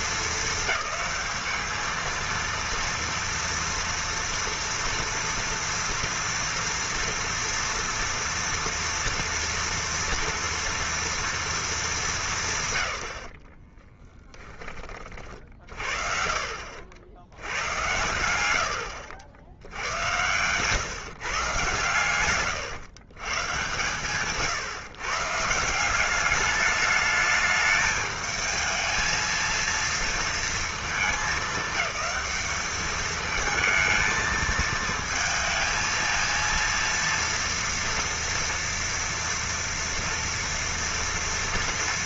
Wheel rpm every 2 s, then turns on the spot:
220, 230, 230, 230, 230, 230, 160, 20, 60, 90, 110, 120, 140, 210, 220, 220, 200, 220, 230, 240, 230.
20-24